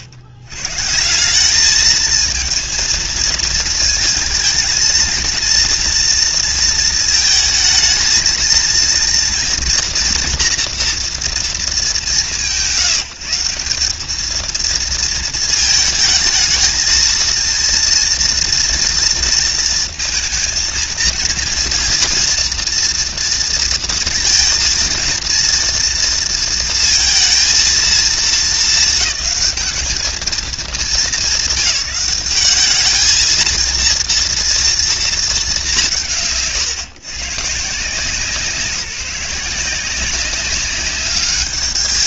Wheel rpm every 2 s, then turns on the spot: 80, 220, 230, 230, 230, 230, 160, 220, 220, 230, 230, 230, 230, 230, 220, 220, 200, 230, 140, 170, 190.
none